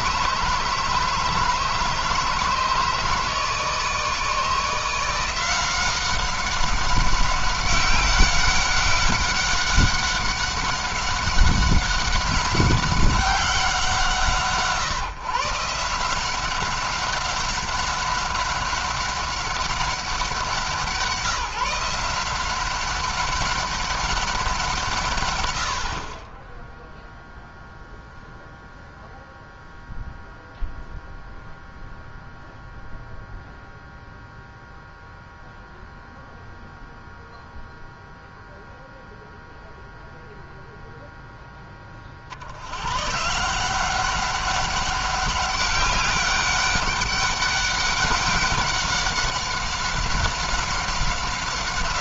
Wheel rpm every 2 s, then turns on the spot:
150, 150, 160, 190, 190, 190, 190, 160, 190, 190, 170, 180, 160, 0, 0, 0, 0, 0, 0, 0, 0, 110, 200, 200, 190, 190.
none